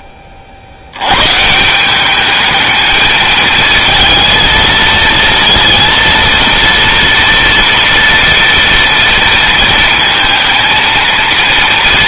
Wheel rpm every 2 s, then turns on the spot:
70, 210, 230, 230, 230, 230.
none